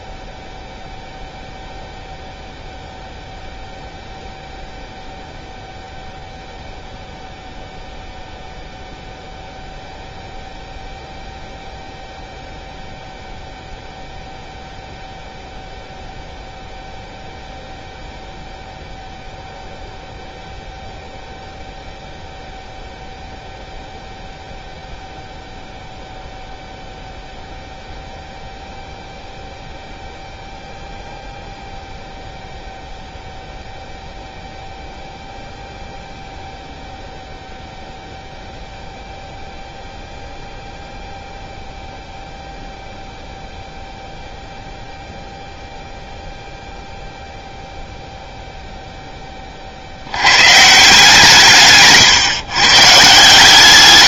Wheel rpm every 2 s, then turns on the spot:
0, 0, 0, 0, 0, 0, 0, 0, 0, 0, 0, 0, 0, 0, 0, 0, 0, 0, 0, 0, 0, 0, 0, 0, 0, 130, 140.
none